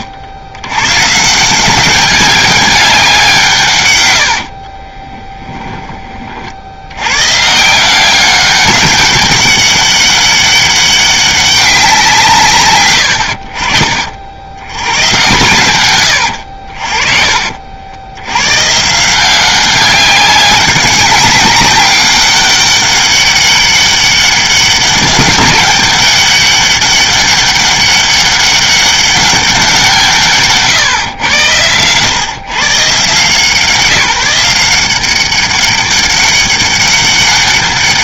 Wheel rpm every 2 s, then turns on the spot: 120, 190, 40, 80, 200, 200, 100, 100, 50, 150, 190, 200, 190, 200, 200, 140, 130, 180, 200.
4-6